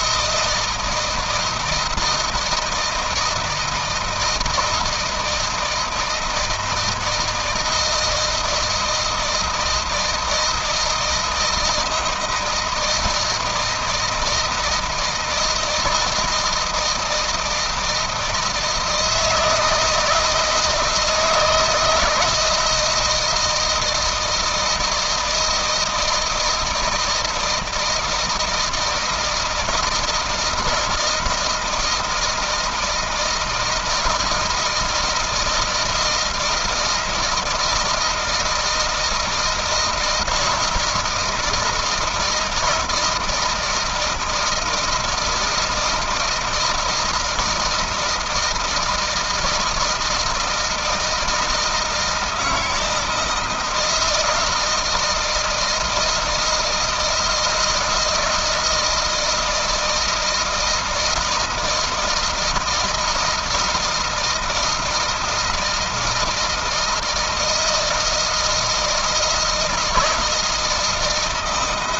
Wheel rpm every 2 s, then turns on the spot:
160, 160, 160, 160, 160, 160, 160, 160, 160, 160, 160, 160, 160, 160, 160, 160, 160, 170, 160, 160, 160, 160, 160, 160, 160, 160, 160, 170, 160, 160, 160, 160, 160, 160, 160, 160.
none